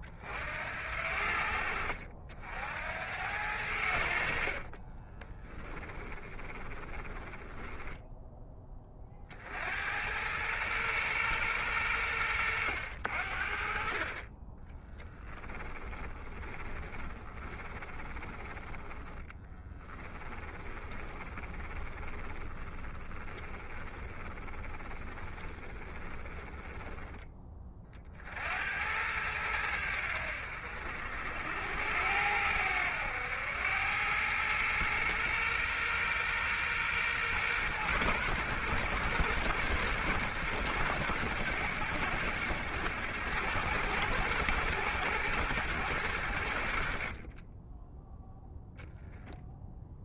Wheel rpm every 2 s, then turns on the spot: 60, 80, 40, 20, 30, 120, 80, 10, 20, 10, 20, 20, 20, 10, 90, 70, 90, 110, 120, 120, 110, 110, 110, 50, 0.
4-8 14-28